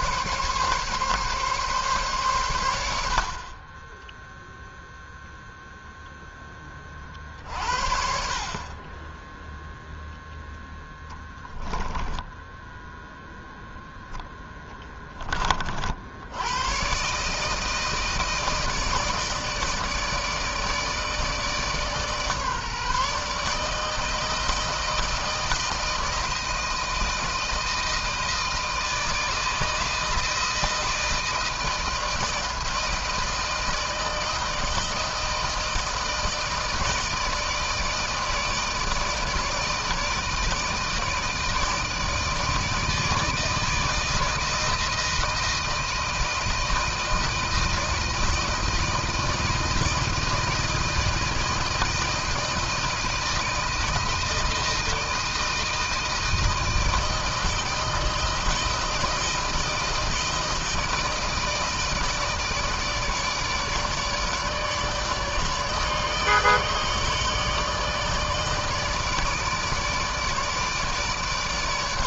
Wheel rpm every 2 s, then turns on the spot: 140, 110, 0, 10, 50, 10, 10, 10, 100, 160, 150, 150, 160, 160, 160, 160, 160, 160, 160, 160, 160, 160, 160, 160, 160, 160, 160, 160, 160, 160, 160, 160, 150, 150, 160, 160.
12-14